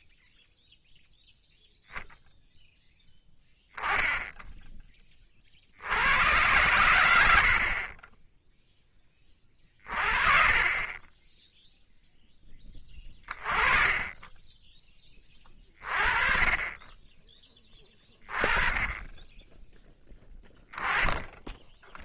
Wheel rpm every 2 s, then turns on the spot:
0, 0, 10, 100, 10, 30, 10, 20, 20, 20, 20.
none